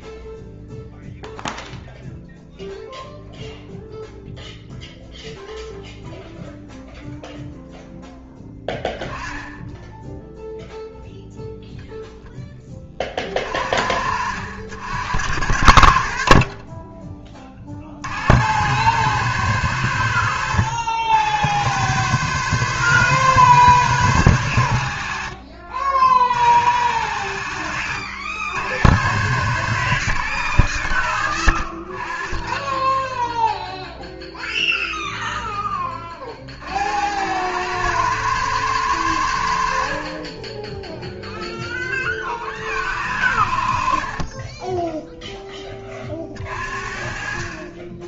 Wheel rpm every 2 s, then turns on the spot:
0, 0, 0, 0, 10, 0, 20, 60, 30, 100, 90, 130, 80, 70, 90, 100, 10, 0, 60, 110, 10, 50, 20, 50.
none